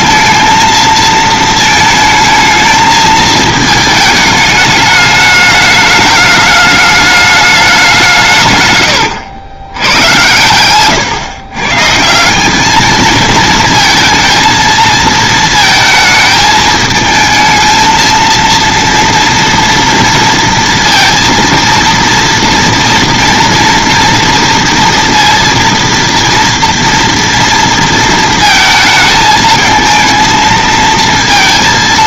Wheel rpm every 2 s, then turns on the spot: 220, 220, 210, 210, 110, 120, 200, 230, 220, 230, 230, 230, 230, 230, 220, 230.
none